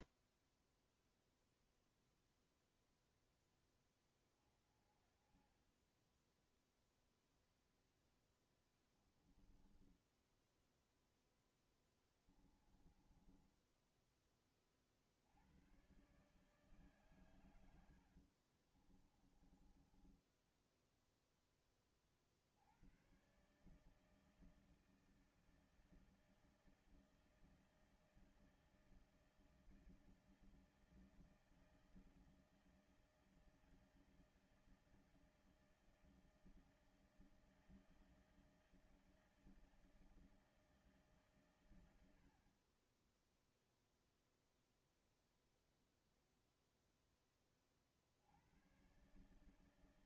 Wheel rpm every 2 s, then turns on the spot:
0, 0, 20, 0, 10, 10, 20, 30, 140, 50, 10, 60, 160, 160, 160, 160, 160, 160, 160, 160, 160, 40, 0, 0, 90.
4-6 8-14 18-22